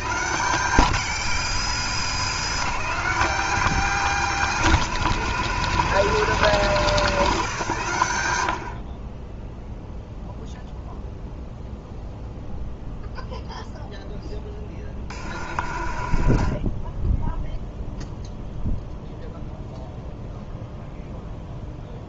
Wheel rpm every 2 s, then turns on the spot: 190, 210, 200, 190, 50, 0, 0, 40, 20, 0, 0.
14-18